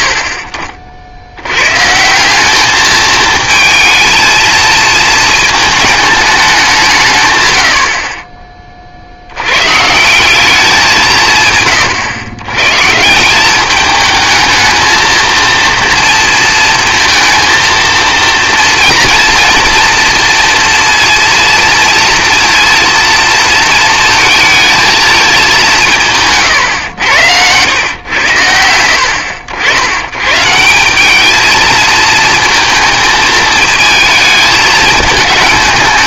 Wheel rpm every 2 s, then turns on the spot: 70, 210, 220, 180, 30, 190, 130, 220, 230, 230, 230, 230, 220, 130, 80, 180, 220, 220.
none